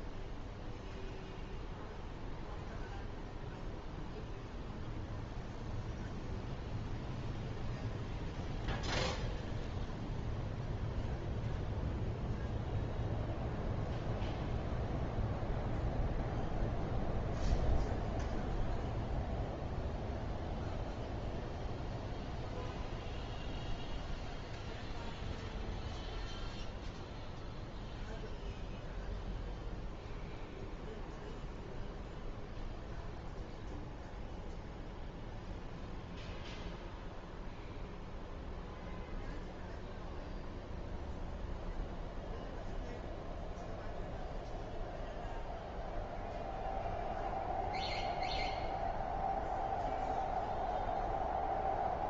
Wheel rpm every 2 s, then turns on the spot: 0, 0, 0, 0, 0, 0, 0, 0, 0, 0, 0, 0, 0, 0, 0, 0, 0, 0, 0, 0, 0, 0, 0, 0, 0, 0.
none